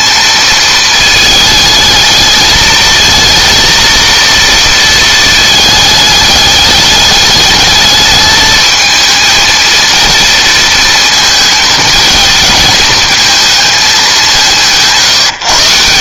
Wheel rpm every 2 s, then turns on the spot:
220, 220, 230, 210, 220, 220, 230, 160.
none